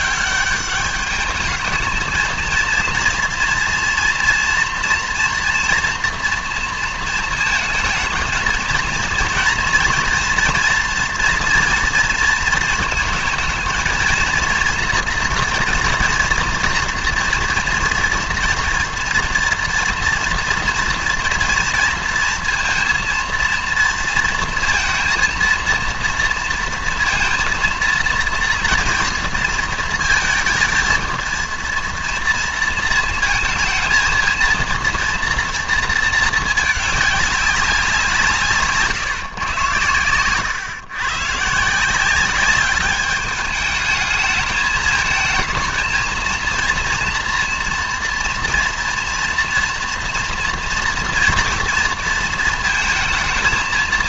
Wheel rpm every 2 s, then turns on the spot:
200, 230, 240, 230, 230, 240, 230, 230, 230, 240, 230, 230, 230, 230, 230, 220, 230, 230, 220, 150, 120, 200, 220, 230, 230, 230, 230.
none